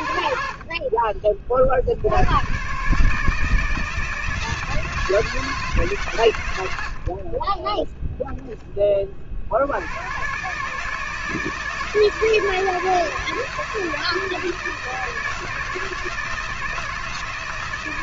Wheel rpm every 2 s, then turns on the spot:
30, 140, 160, 60, 20, 150, 160, 160, 160.
none